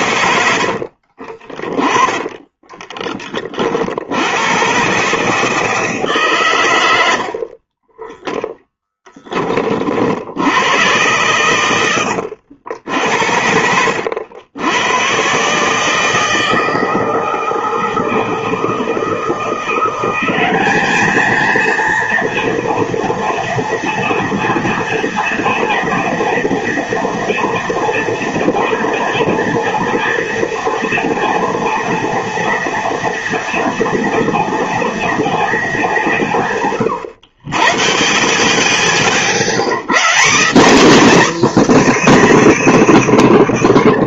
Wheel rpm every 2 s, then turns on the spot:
80, 20, 130, 110, 10, 110, 80, 100, 160, 160, 210, 230, 240, 240, 230, 230, 230, 230, 140, 50, 270, 310.
0-4 6-8